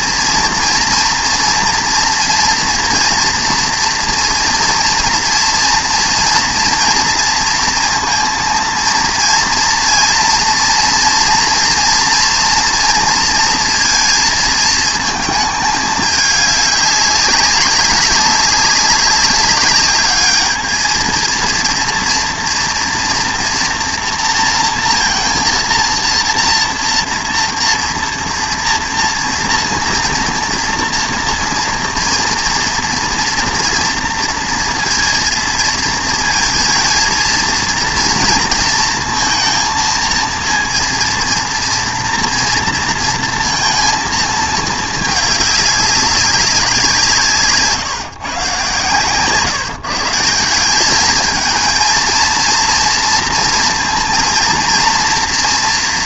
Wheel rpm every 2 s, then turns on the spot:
230, 230, 230, 230, 230, 230, 230, 220, 200, 200, 220, 230, 230, 230, 230, 230, 230, 230, 220, 230, 230, 230, 220, 190, 130, 190, 230, 230.
none